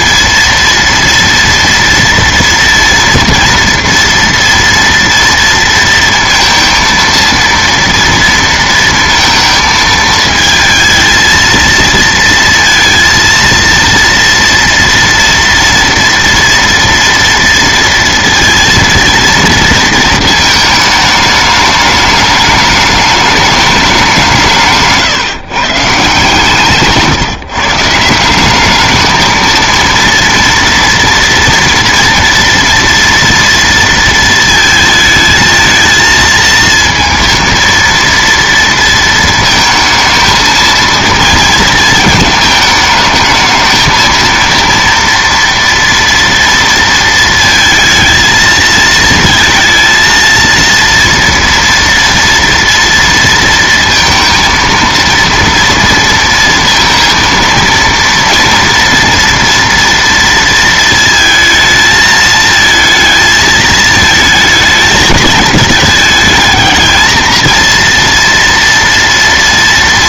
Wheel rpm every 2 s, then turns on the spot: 230, 230, 230, 230, 230, 220, 230, 230, 230, 230, 220, 210, 160, 140, 190, 230, 230, 220, 230, 230, 230, 220, 230, 230, 220, 230, 230, 230, 230, 230, 230, 220, 220, 220, 230.
none